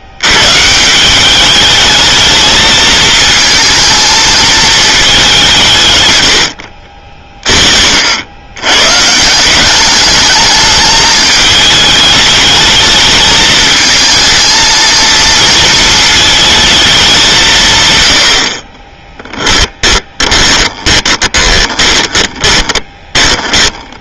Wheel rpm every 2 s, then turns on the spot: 160, 220, 220, 60, 120, 210, 210, 230, 220, 40, 30, 20.
18-24